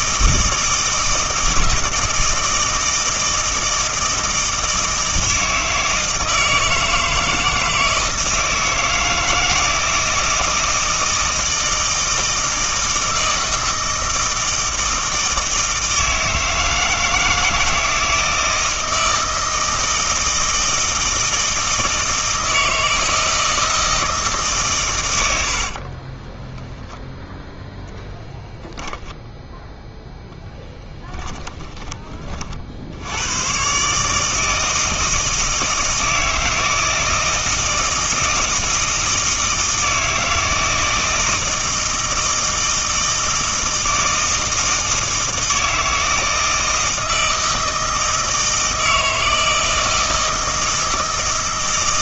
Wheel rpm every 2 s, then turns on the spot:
160, 160, 160, 160, 160, 160, 160, 160, 160, 160, 160, 160, 130, 0, 0, 10, 60, 160, 160, 160, 160, 160, 160, 160, 160, 160.
none